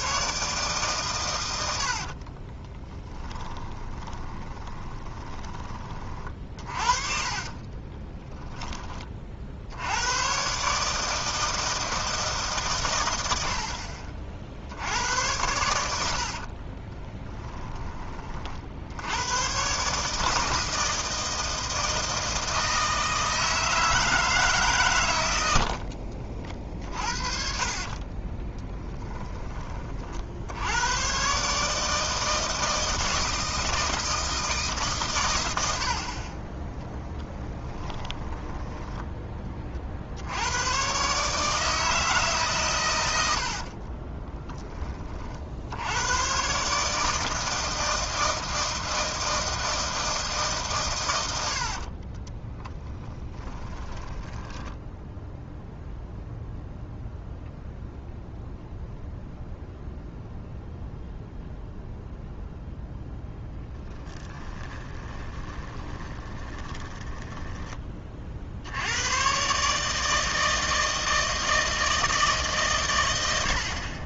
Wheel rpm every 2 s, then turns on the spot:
140, 10, 20, 30, 20, 140, 120, 80, 30, 70, 160, 160, 140, 50, 10, 90, 160, 150, 10, 10, 120, 120, 10, 140, 160, 120, 10, 10, 0, 0, 0, 0, 20, 20, 90, 160, 130.
2-8 16-18 26-30 36-38 52-56 64-68